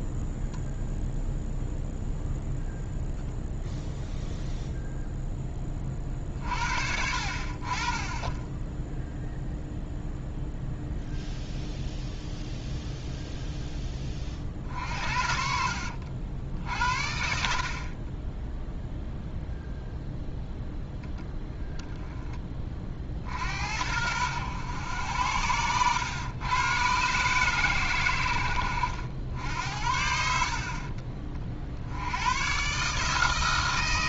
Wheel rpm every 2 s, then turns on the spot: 0, 0, 0, 50, 10, 0, 0, 50, 60, 0, 0, 40, 100, 120, 80, 60, 130.
none